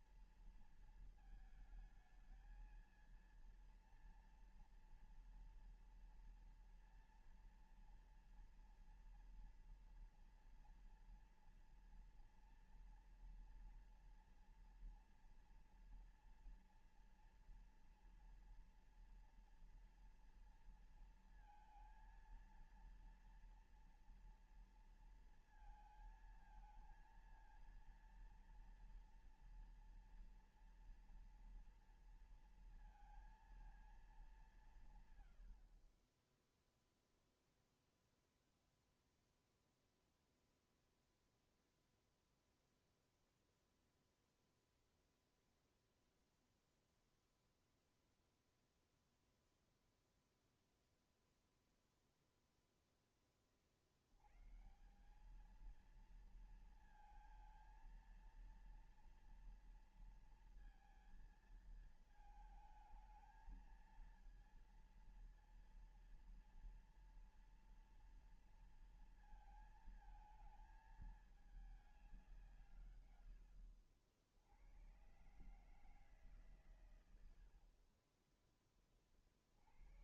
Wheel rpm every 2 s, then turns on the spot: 230, 230, 230, 230, 230, 230, 230, 230, 230, 230, 230, 230, 230, 220, 230, 230, 230, 150, 0, 0, 0, 0, 0, 0, 0, 0, 0, 140, 230, 230, 230, 220, 230, 230, 230, 220, 140, 110, 110, 20.
none